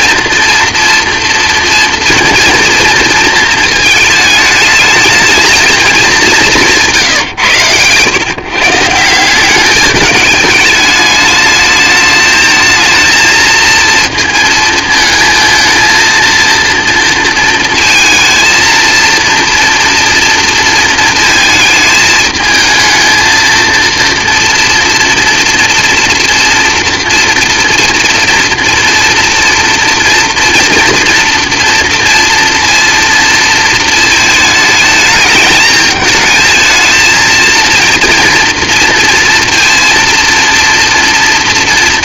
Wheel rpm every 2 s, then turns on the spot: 240, 230, 220, 170, 160, 210, 220, 220, 230, 220, 230, 220, 240, 230, 230, 230, 230, 210, 220, 230, 230.
none